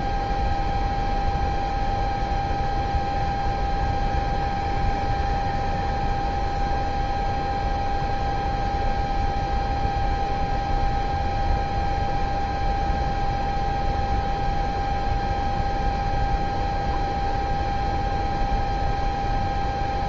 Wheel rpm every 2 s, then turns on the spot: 0, 0, 0, 0, 0, 0, 0, 0, 0, 0.
none